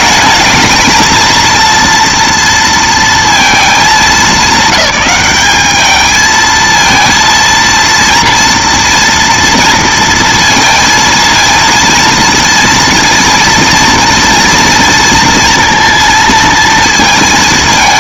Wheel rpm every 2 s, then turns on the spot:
220, 230, 190, 220, 230, 230, 230, 230, 230.
none